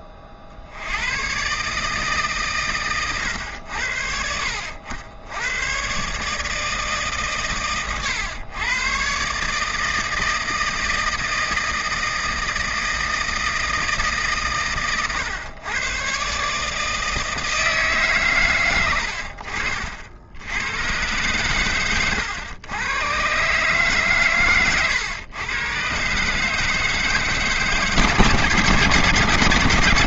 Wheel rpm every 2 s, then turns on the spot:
60, 130, 70, 150, 120, 160, 160, 130, 150, 120, 90, 110, 120, 150, 150.
none